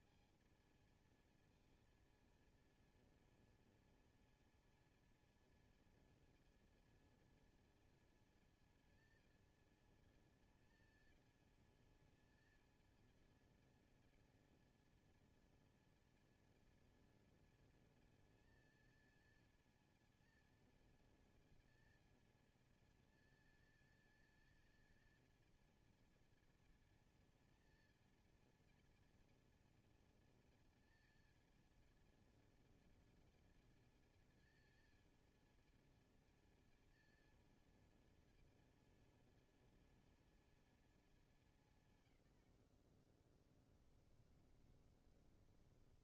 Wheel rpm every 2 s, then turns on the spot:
230, 230, 230, 230, 230, 230, 220, 230, 230, 230, 230, 230, 230, 230, 230, 220, 230, 230, 230, 230, 230, 80, 50.
44-46